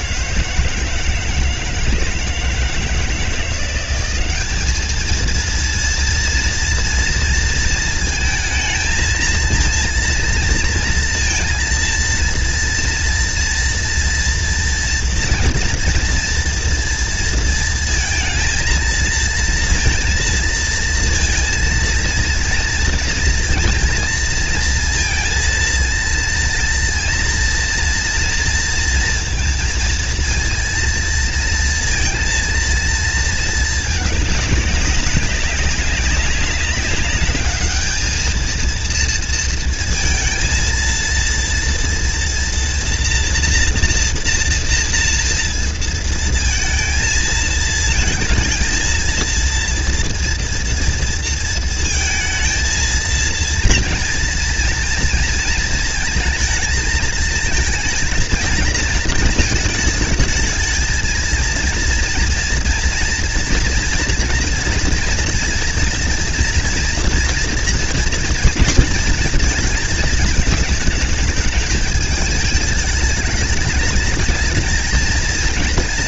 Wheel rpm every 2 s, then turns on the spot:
160, 160, 220, 230, 230, 230, 230, 230, 230, 230, 230, 230, 230, 230, 230, 230, 220, 190, 210, 230, 230, 230, 230, 220, 220, 230, 230, 220, 220, 230, 220, 230, 230, 230, 230, 210, 210, 220.
none